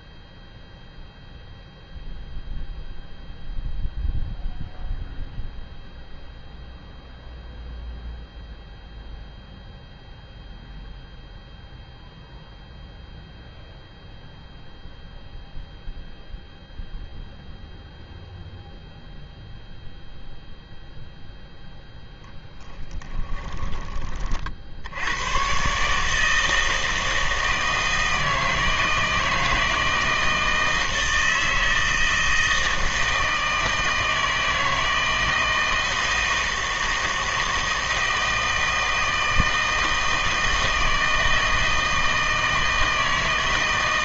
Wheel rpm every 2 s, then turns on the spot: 0, 0, 0, 0, 0, 0, 0, 0, 0, 0, 0, 10, 60, 160, 160, 160, 160, 160, 160, 160, 160, 160.
22-24